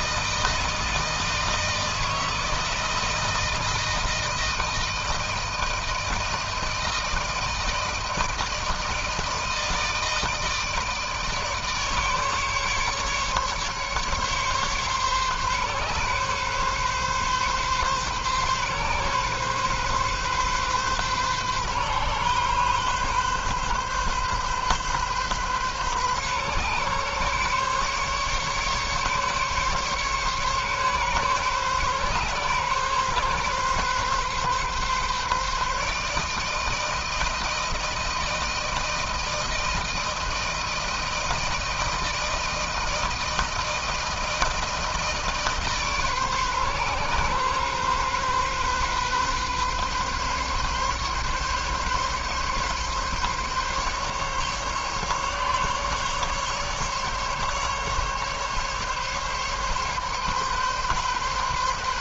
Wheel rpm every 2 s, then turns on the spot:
160, 160, 160, 160, 160, 160, 150, 140, 140, 140, 130, 140, 140, 130, 140, 140, 130, 140, 160, 160, 160, 160, 160, 140, 130, 140, 140, 140, 140, 140, 140.
none